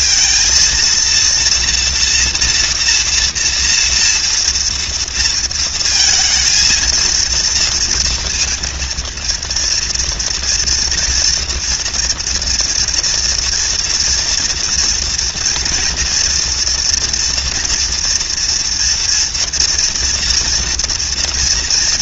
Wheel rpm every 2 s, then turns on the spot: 230, 230, 230, 230, 230, 230, 230, 230, 240, 240, 240.
none